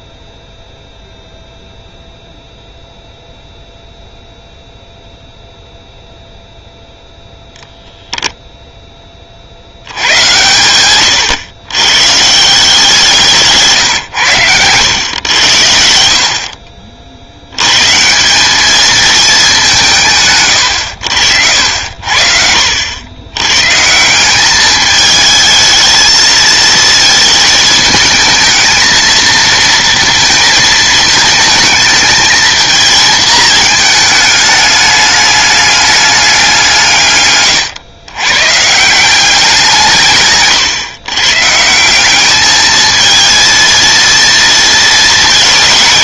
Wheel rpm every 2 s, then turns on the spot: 0, 0, 0, 0, 0, 110, 180, 110, 50, 200, 110, 80, 210, 230, 220, 220, 220, 210, 160, 150, 130, 220, 230.
none